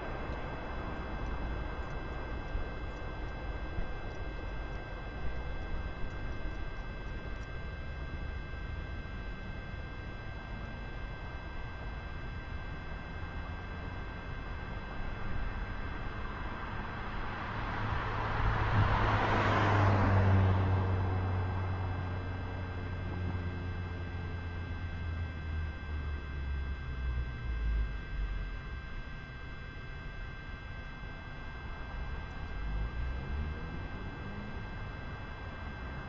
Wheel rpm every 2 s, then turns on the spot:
0, 0, 0, 0, 0, 0, 0, 0, 0, 0, 0, 0, 0, 0, 0, 0, 0, 0.
none